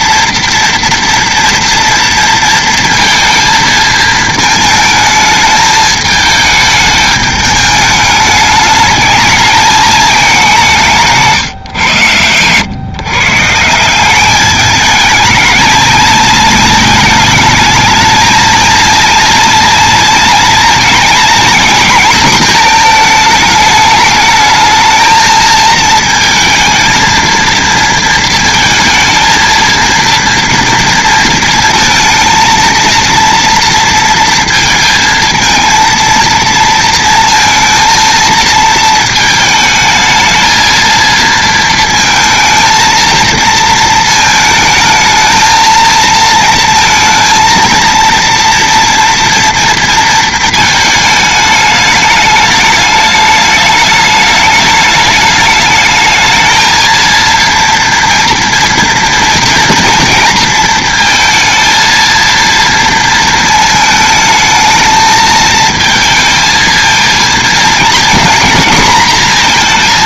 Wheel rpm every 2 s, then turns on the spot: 230, 230, 220, 210, 210, 160, 150, 220, 220, 230, 230, 220, 220, 230, 230, 230, 230, 230, 230, 220, 230, 220, 220, 220, 230, 220, 210, 210, 230, 230, 230, 230, 220, 230, 240.
none